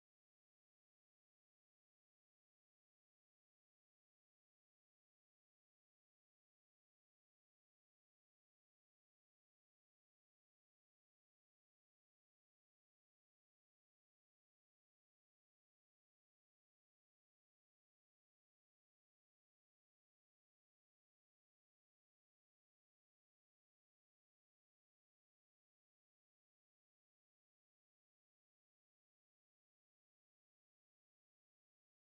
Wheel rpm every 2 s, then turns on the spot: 140, 150, 200, 120, 190, 120, 140, 160, 170, 180, 100, 110, 170, 140, 160, 130.
2-4 6-8 20-22 28-30